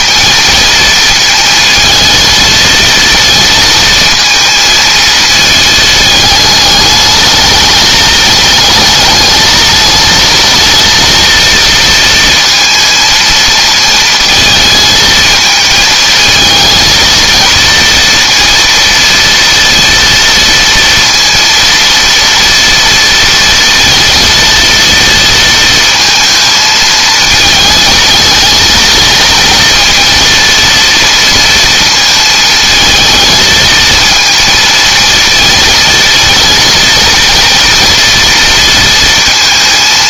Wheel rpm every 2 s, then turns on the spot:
230, 230, 230, 220, 220, 230, 230, 220, 220, 230, 230, 230, 230, 220, 230, 230, 230, 220, 230, 230.
none